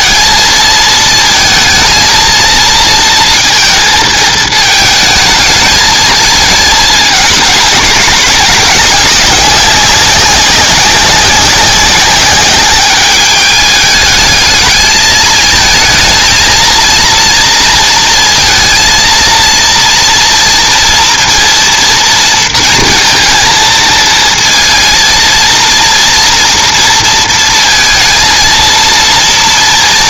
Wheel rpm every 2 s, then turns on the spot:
220, 230, 220, 220, 200, 190, 200, 210, 230, 230, 230, 230, 230, 230, 230.
none